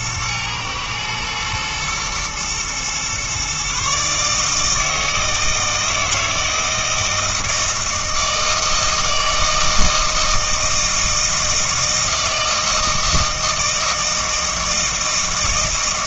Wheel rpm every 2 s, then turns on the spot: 110, 120, 160, 160, 160, 160, 160, 160.
none